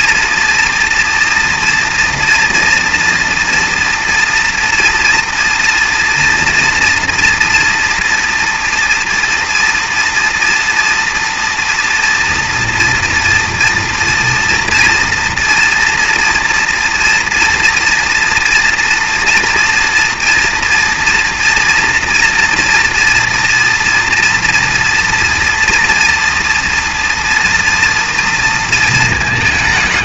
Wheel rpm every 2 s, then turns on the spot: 230, 230, 230, 230, 230, 230, 230, 230, 230, 230, 230, 230, 230, 240, 230.
none